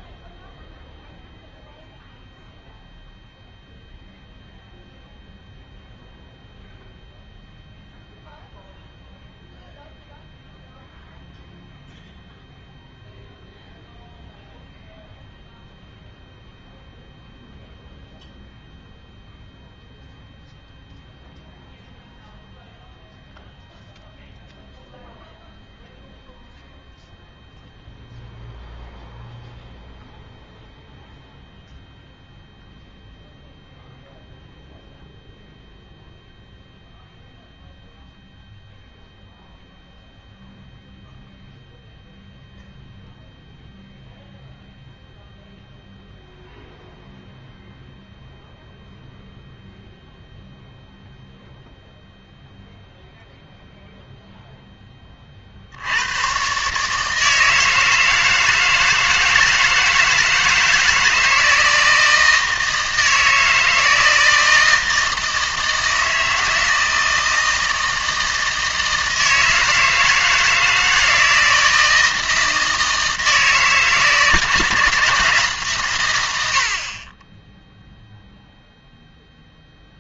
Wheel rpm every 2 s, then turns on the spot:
0, 0, 0, 0, 0, 0, 0, 0, 0, 0, 0, 0, 0, 0, 0, 0, 0, 0, 0, 0, 0, 0, 0, 0, 0, 0, 0, 0, 140, 170, 160, 160, 160, 160, 160, 160, 160, 160, 70, 0.
none